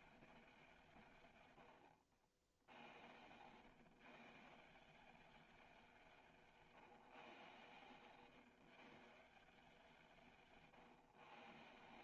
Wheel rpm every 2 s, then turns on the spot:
190, 80, 170, 160, 150, 150.
none